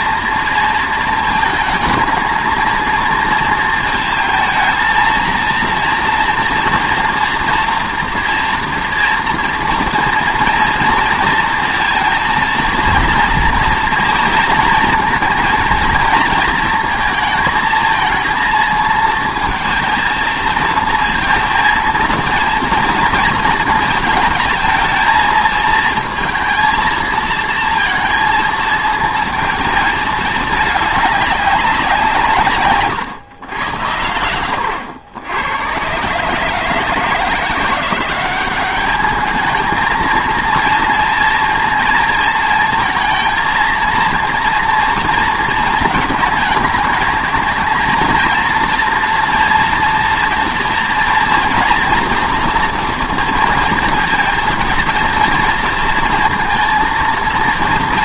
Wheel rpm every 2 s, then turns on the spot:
230, 230, 230, 230, 230, 230, 230, 230, 230, 220, 230, 230, 220, 230, 220, 210, 140, 90, 160, 200, 230, 230, 230, 220, 230, 230, 230, 230, 230.
none